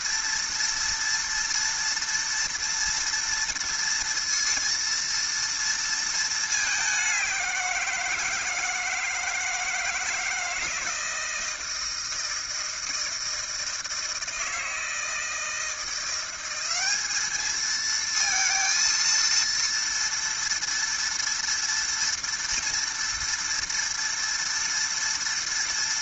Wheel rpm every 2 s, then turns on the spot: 230, 230, 230, 210, 160, 160, 160, 160, 190, 230, 230, 230, 230.
none